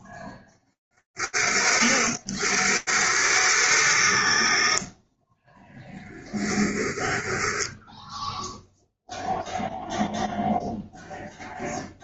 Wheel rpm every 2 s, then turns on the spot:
60, 10, 10, 0, 0, 40.
2-6